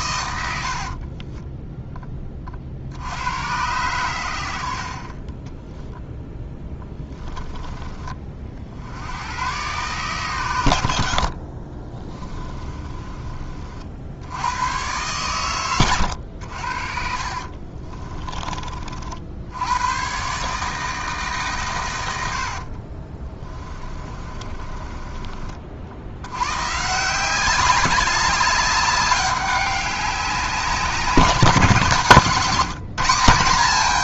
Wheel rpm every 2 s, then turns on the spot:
60, 60, 50, 10, 80, 80, 30, 110, 60, 50, 150, 40, 20, 150, 200, 190, 170.
0-2 12-14 16-18 22-26